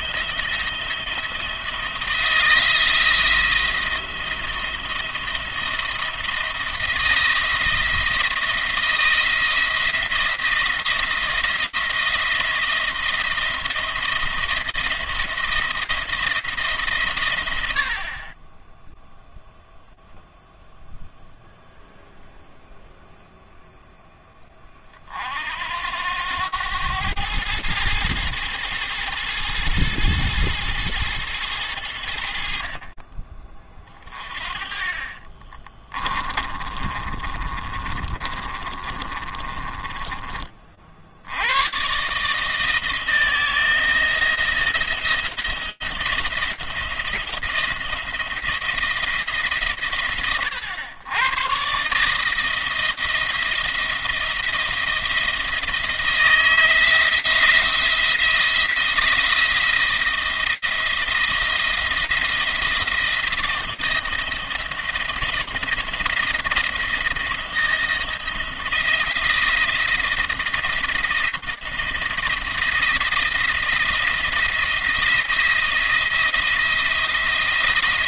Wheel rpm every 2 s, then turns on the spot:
170, 170, 170, 170, 170, 170, 170, 170, 140, 10, 0, 0, 50, 100, 110, 110, 40, 40, 30, 30, 60, 160, 160, 170, 170, 110, 160, 170, 170, 170, 170, 170, 160, 170, 170, 170, 170, 170, 170.
34-40